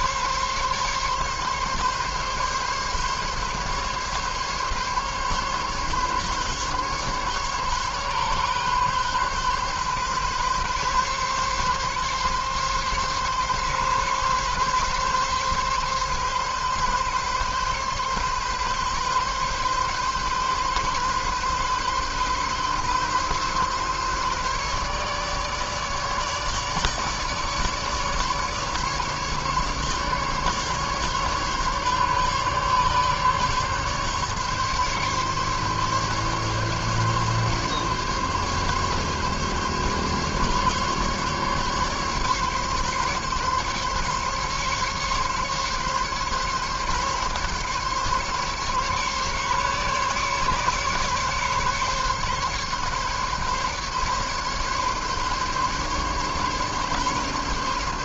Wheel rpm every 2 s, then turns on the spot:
140, 140, 140, 140, 140, 130, 140, 140, 140, 140, 140, 140, 140, 150, 150, 140, 140, 140, 140, 140, 140, 140, 140, 140, 140, 140, 140, 140, 140.
none